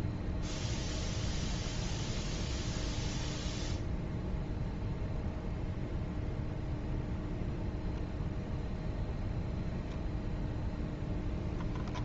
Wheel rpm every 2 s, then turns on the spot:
0, 0, 0, 0, 0, 0.
none